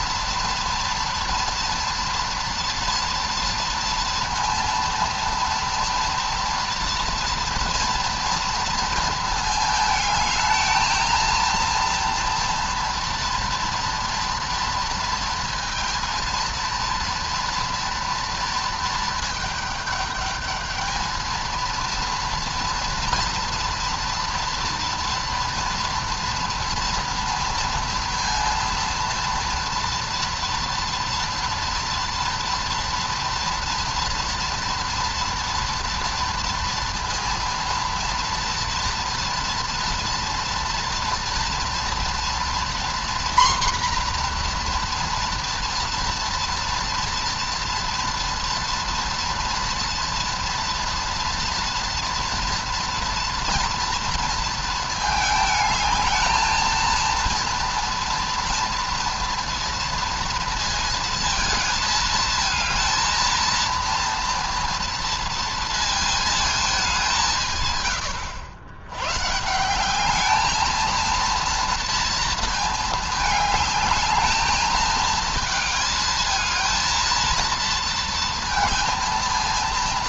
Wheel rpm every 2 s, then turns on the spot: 230, 230, 230, 230, 230, 220, 240, 230, 230, 230, 210, 230, 230, 230, 230, 230, 230, 230, 230, 230, 230, 240, 240, 230, 230, 230, 230, 230, 220, 230, 230, 230, 230, 220, 90, 210, 230, 220, 220, 230.
none